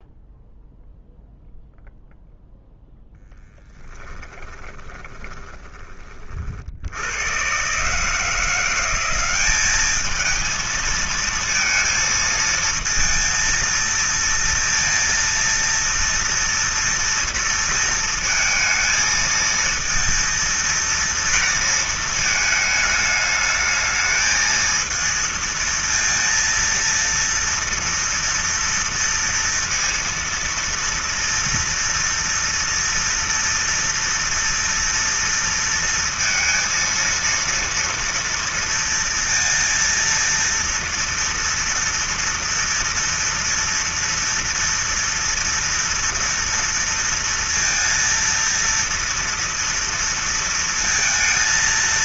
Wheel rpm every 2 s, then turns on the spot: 0, 0, 20, 80, 180, 230, 230, 230, 230, 220, 230, 210, 230, 230, 230, 230, 230, 230, 230, 230, 230, 230, 230, 230, 230, 230.
4-6